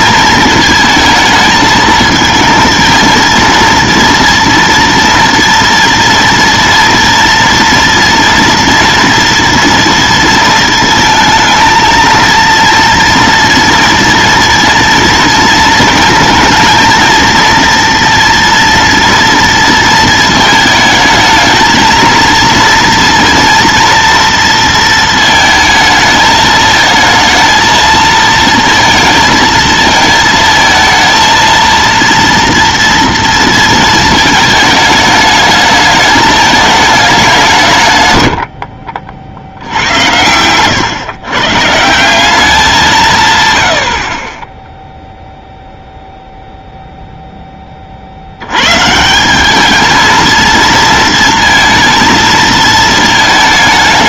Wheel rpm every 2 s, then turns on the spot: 220, 220, 230, 230, 230, 230, 230, 230, 230, 230, 220, 230, 230, 220, 230, 220, 230, 220, 220, 80, 110, 190, 10, 0, 110, 220, 230.
40-42